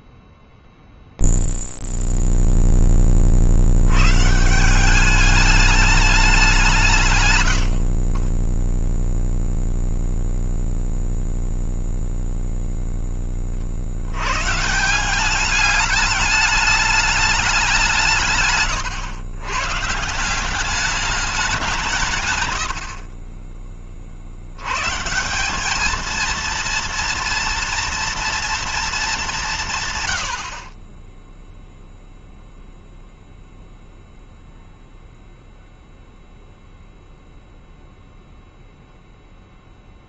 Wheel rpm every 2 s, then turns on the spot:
0, 20, 180, 160, 0, 0, 20, 180, 200, 130, 190, 40, 180, 230, 190, 0, 0, 0, 0, 0.
6-8